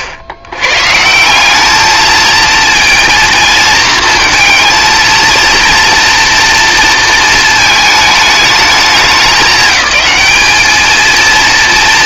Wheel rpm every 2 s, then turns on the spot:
90, 230, 230, 230, 200, 220.
none